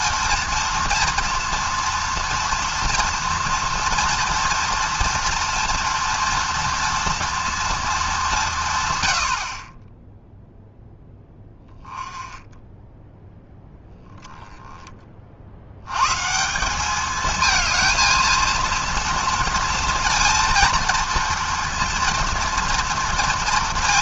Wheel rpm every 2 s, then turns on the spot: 240, 230, 230, 230, 160, 0, 10, 10, 170, 230, 230, 230.
none